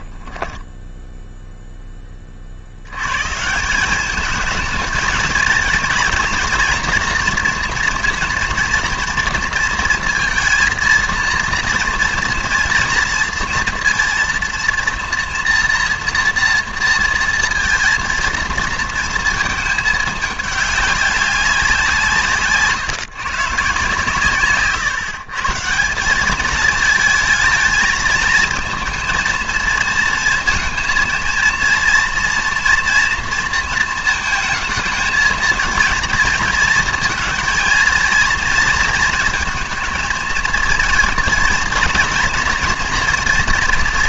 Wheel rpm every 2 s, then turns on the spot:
10, 70, 220, 230, 230, 220, 230, 230, 230, 230, 210, 140, 140, 220, 230, 230, 230, 230, 230, 230, 230, 230.
none